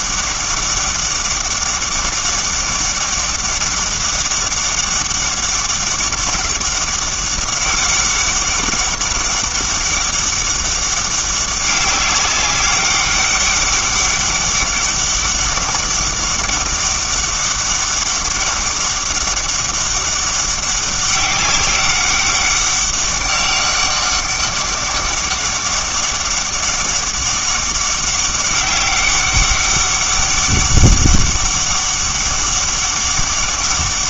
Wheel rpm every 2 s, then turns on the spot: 200, 200, 200, 200, 200, 200, 200, 200, 200, 200, 190, 200, 200, 200, 200, 200, 200.
none